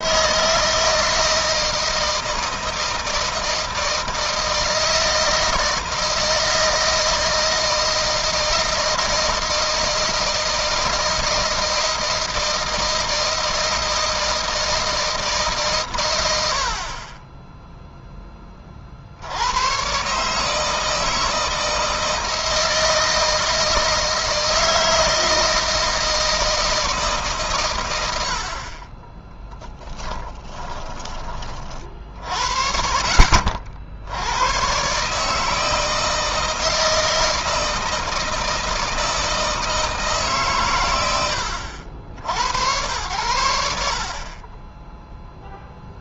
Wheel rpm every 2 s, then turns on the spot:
160, 160, 160, 160, 160, 160, 160, 160, 50, 50, 160, 160, 160, 160, 40, 20, 60, 130, 160, 160, 130, 80, 10.
none